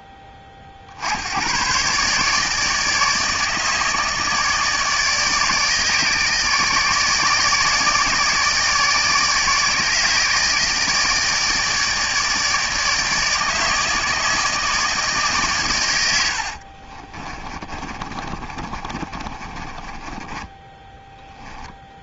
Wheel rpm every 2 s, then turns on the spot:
50, 150, 160, 150, 150, 160, 150, 150, 30, 30, 10.
16-22